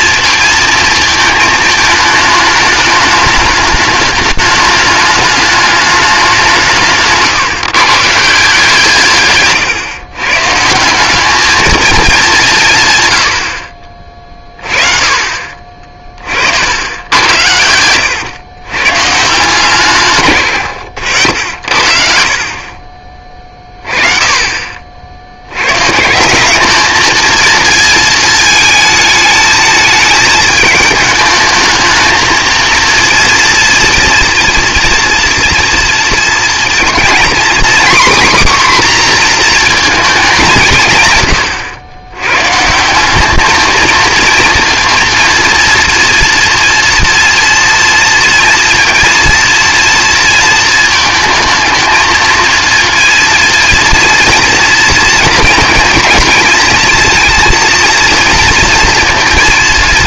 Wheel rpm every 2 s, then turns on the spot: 220, 210, 210, 170, 160, 150, 180, 30, 80, 120, 100, 40, 40, 200, 220, 210, 230, 240, 230, 260, 170, 150, 230, 230, 230, 220, 230, 230, 230, 230.
none